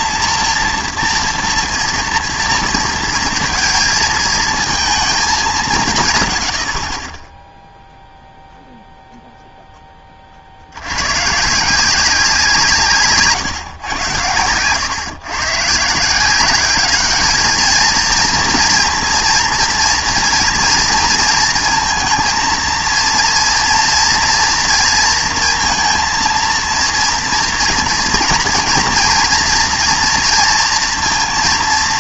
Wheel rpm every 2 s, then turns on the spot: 230, 230, 230, 100, 0, 60, 180, 110, 190, 230, 230, 230, 230, 230, 240, 230.
none